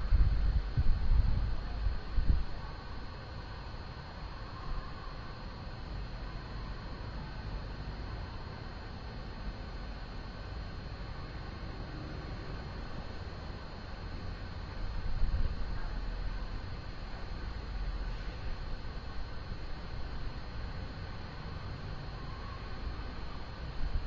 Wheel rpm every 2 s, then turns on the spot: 0, 0, 0, 0, 0, 0, 0, 0, 0, 0, 0, 0.
none